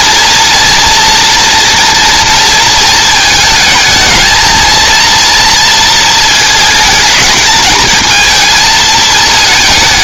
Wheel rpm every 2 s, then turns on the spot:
230, 230, 220, 220, 220.
none